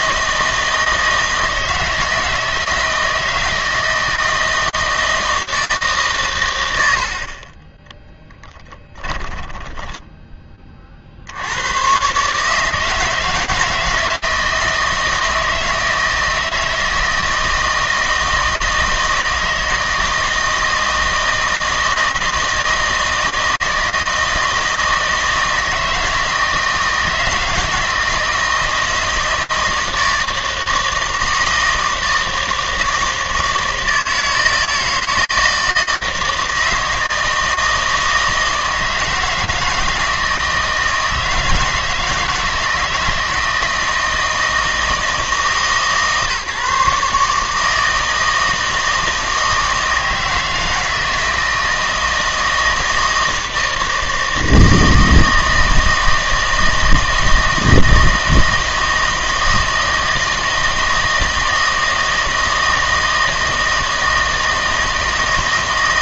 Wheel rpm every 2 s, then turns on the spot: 160, 160, 160, 100, 10, 30, 150, 160, 160, 160, 160, 160, 160, 160, 160, 160, 160, 160, 160, 160, 160, 160, 160, 150, 160, 160, 160, 160, 160, 160, 160, 160, 160.
8-10